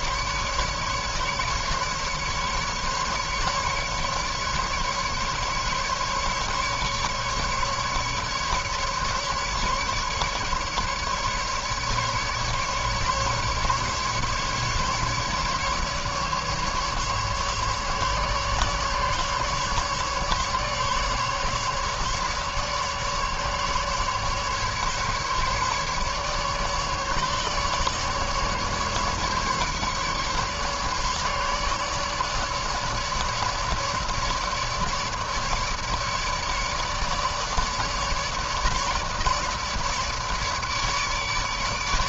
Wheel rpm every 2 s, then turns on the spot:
150, 150, 150, 150, 150, 140, 140, 150, 140, 150, 150, 140, 150, 150, 140, 150, 150, 150, 150, 150, 150.
none